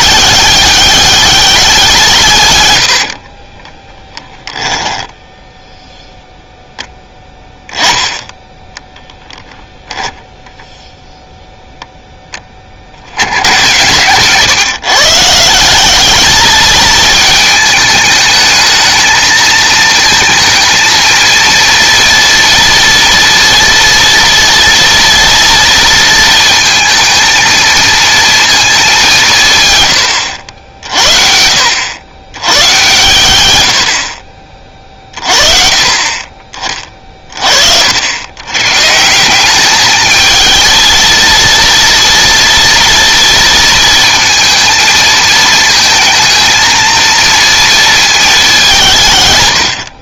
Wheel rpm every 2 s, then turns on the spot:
200, 120, 10, 0, 10, 0, 30, 140, 220, 220, 220, 230, 230, 230, 210, 60, 110, 40, 40, 120, 220, 230, 220, 230, 180.
4-6